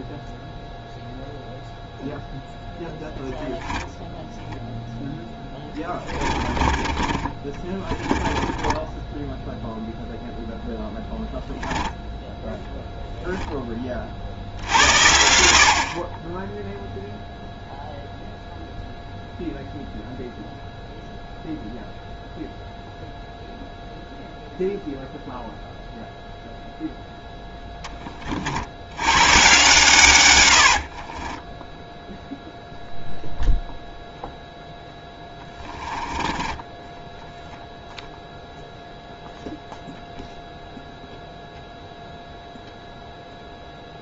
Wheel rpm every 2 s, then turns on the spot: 0, 10, 0, 30, 20, 0, 0, 60, 10, 0, 0, 0, 0, 0, 70, 80, 0, 0, 10, 0, 0, 0.
6-10 30-32 36-38